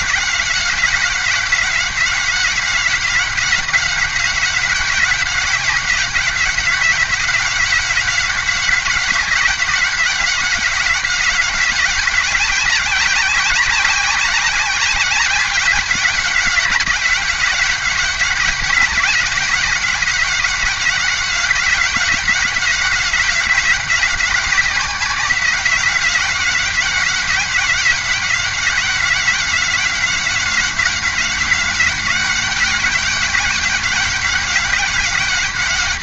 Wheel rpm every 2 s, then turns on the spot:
190, 190, 190, 190, 190, 190, 190, 190, 180, 190, 190, 180, 190, 190, 190, 190, 190, 190.
none